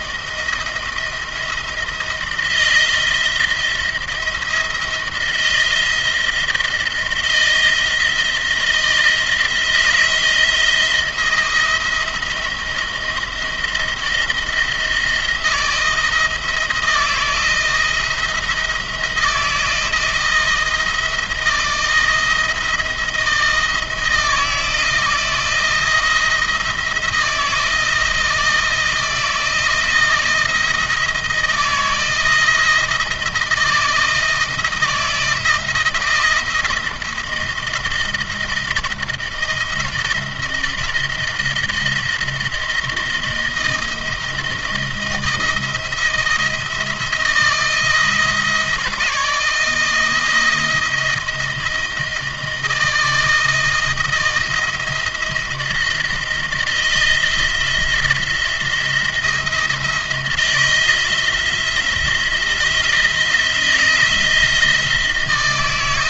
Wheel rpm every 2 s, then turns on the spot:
170, 170, 170, 160, 170, 170, 170, 170, 160, 170, 160, 160, 170, 170, 170, 160, 160, 160, 160, 160, 170, 170, 160, 170, 170, 170, 160, 160, 160, 170, 170, 170, 160.
none